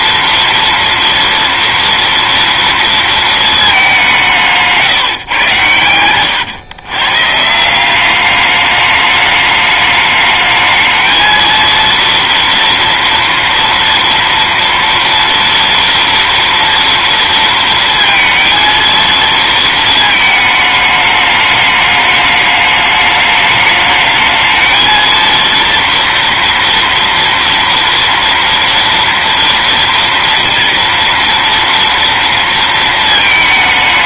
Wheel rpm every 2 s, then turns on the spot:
230, 230, 160, 130, 210, 220, 230, 230, 230, 230, 210, 210, 230, 230, 230, 230, 220.
none